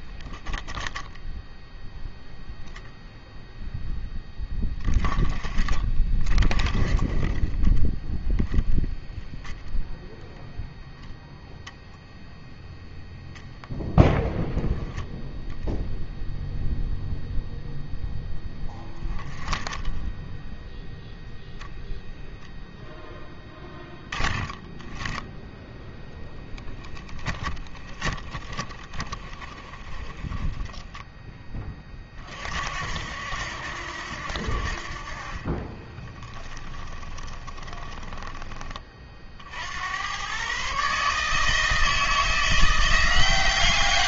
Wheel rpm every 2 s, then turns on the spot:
10, 0, 20, 30, 0, 0, 0, 10, 0, 10, 0, 0, 20, 20, 20, 10, 50, 60, 20, 20, 130, 170.
26-32 36-38